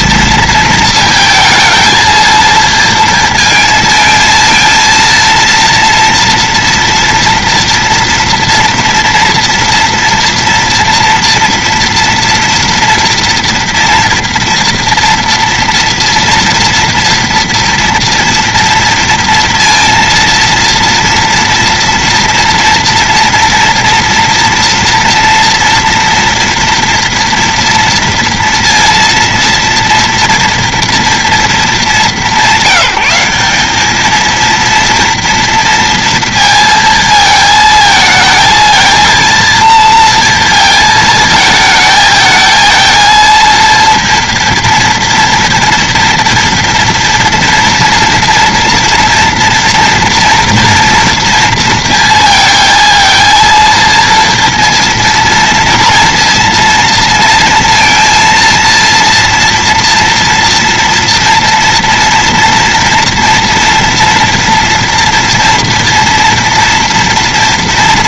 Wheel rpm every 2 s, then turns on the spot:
230, 230, 230, 230, 230, 230, 230, 230, 230, 230, 230, 230, 230, 230, 230, 230, 190, 230, 230, 220, 230, 230, 230, 230, 230, 230, 230, 230, 230, 230, 230, 240, 230, 230.
none